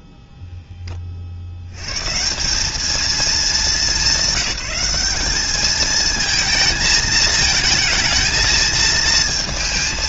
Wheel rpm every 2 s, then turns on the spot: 30, 210, 210, 220, 220.
none